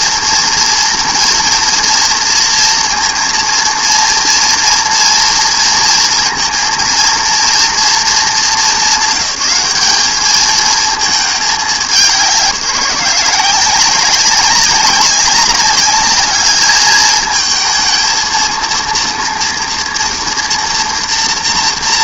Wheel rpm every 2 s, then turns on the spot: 230, 230, 230, 230, 200, 220, 190, 200, 210, 230, 230.
none